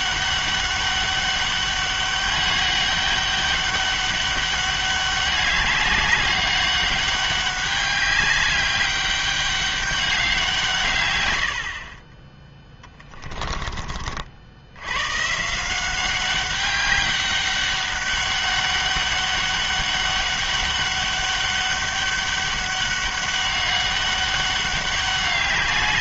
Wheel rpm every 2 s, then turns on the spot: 200, 200, 200, 200, 200, 170, 10, 80, 200, 200, 200, 200, 200.
12-14